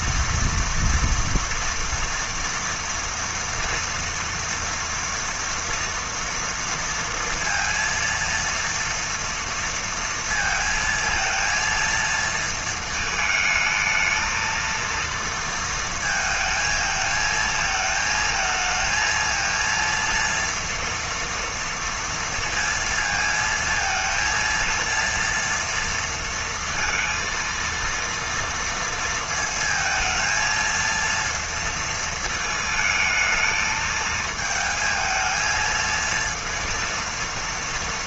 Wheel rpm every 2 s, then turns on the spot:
240, 240, 230, 230, 230, 230, 220, 230, 220, 230, 230, 230, 230, 230, 230, 230, 220, 220, 230.
none